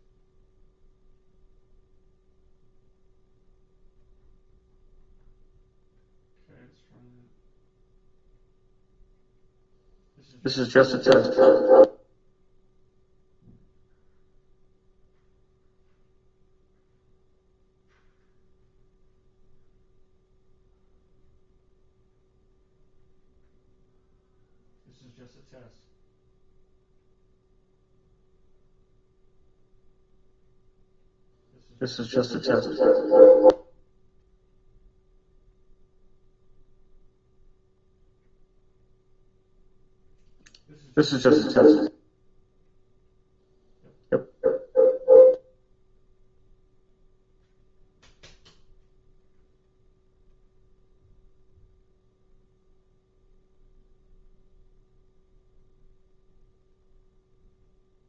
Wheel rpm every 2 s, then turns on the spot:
0, 0, 0, 0, 0, 0, 0, 0, 0, 0, 0, 0, 0, 0, 0, 0, 0, 0, 0, 0, 0, 0, 0, 0, 0, 0, 0, 0, 0.
none